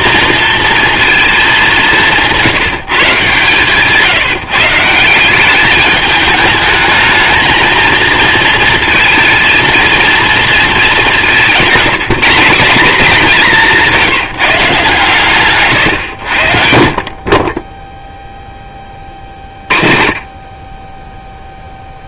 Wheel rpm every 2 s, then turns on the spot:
220, 170, 160, 210, 230, 220, 190, 150, 60, 10, 30.
none